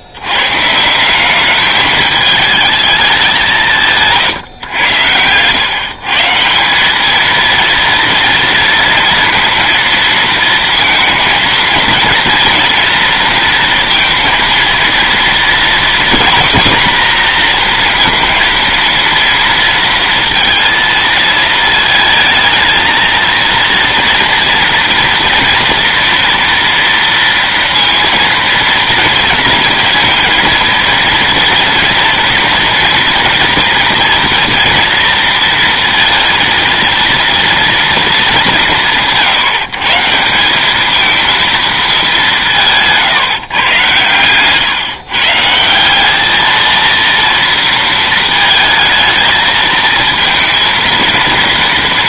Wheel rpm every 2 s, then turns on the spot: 210, 160, 150, 230, 230, 230, 230, 240, 230, 230, 220, 230, 230, 230, 230, 230, 230, 230, 210, 140, 210, 130, 190, 230, 220, 230.
none